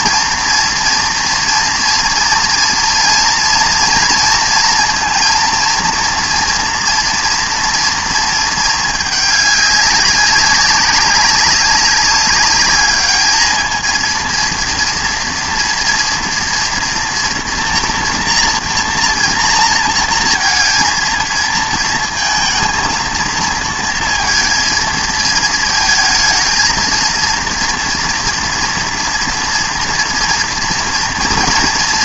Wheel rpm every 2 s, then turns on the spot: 230, 240, 230, 240, 220, 190, 210, 230, 230, 230, 230, 220, 230, 230, 230, 240.
none